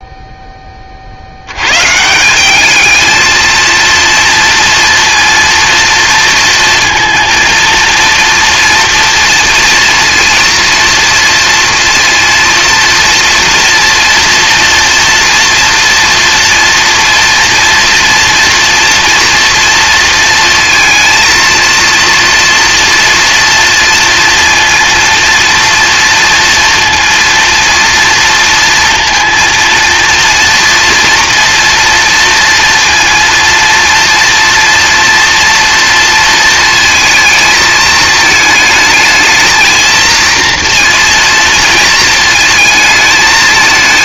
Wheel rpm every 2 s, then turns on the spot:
30, 210, 230, 230, 240, 230, 230, 230, 230, 230, 230, 230, 230, 230, 230, 230, 230, 230, 220, 220, 230, 220.
none